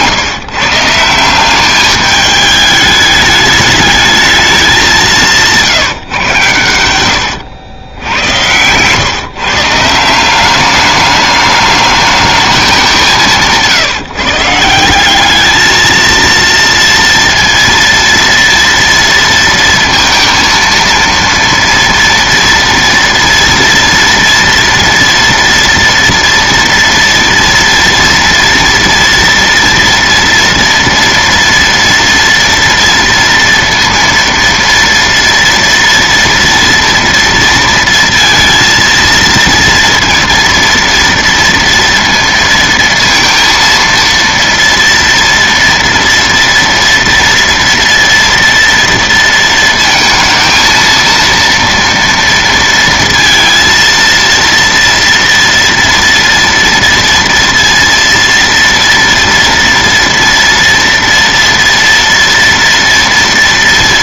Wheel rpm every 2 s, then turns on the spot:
160, 210, 200, 110, 110, 200, 200, 170, 230, 230, 230, 230, 230, 230, 230, 240, 230, 230, 230, 230, 230, 230, 230, 230, 230, 220, 230, 230, 230, 230, 240, 230.
none